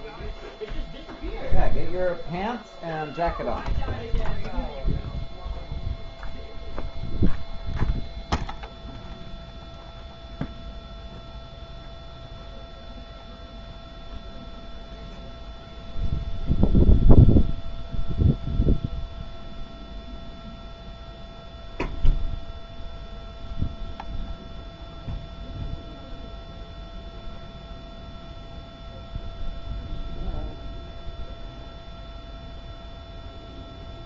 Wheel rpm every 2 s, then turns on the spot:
0, 0, 0, 0, 0, 0, 0, 0, 0, 0, 0, 0, 0, 0, 0, 0, 0.
none